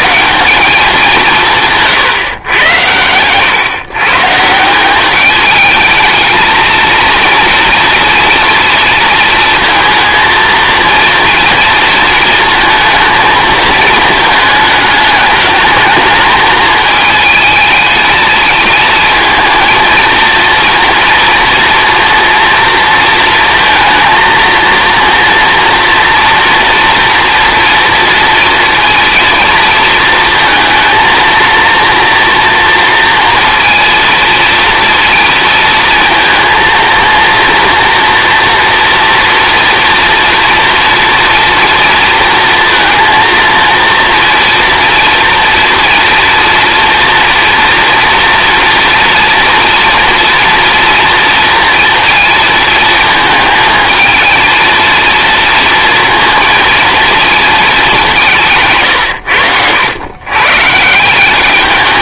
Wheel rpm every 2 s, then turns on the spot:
190, 110, 170, 220, 230, 230, 220, 210, 210, 220, 230, 230, 230, 240, 230, 230, 230, 230, 230, 230, 230, 230, 230, 230, 230, 230, 220, 220, 230, 150, 150.
none